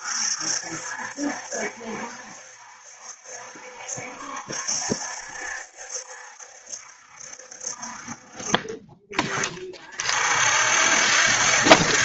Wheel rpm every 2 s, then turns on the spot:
70, 70, 60, 60, 30, 50.
8-10